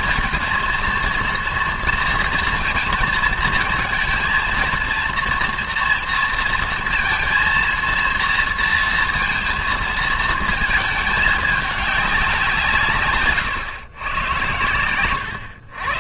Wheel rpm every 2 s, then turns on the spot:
230, 230, 230, 230, 230, 220, 180, 110.
none